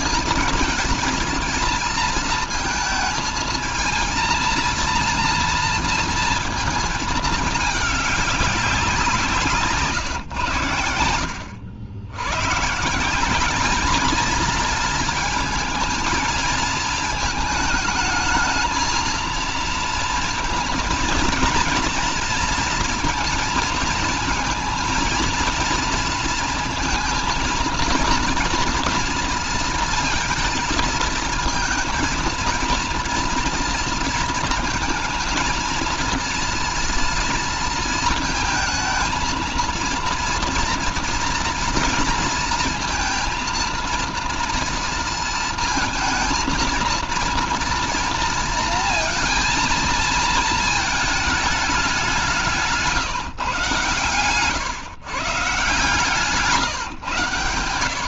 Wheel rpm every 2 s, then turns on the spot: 230, 230, 230, 230, 190, 100, 150, 230, 220, 220, 230, 230, 230, 230, 240, 230, 230, 230, 230, 230, 230, 230, 230, 230, 230, 220, 170, 130, 140.
none